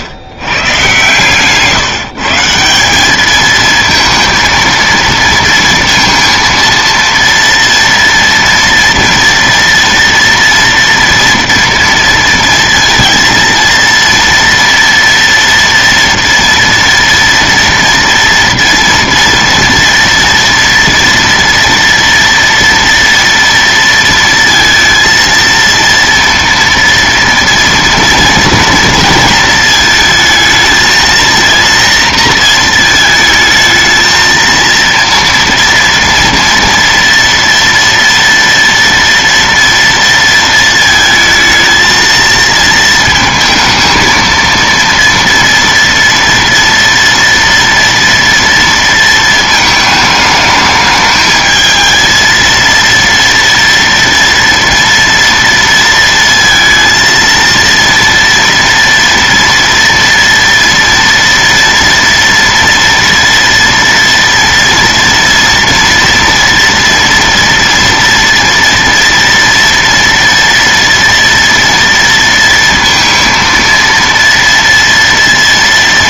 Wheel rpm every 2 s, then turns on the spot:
130, 160, 230, 230, 230, 230, 230, 230, 230, 230, 240, 230, 230, 230, 230, 220, 230, 230, 230, 230, 230, 230, 230, 230, 230, 220, 230, 230, 230, 230, 230, 230, 230, 230, 230, 230, 230, 230.
none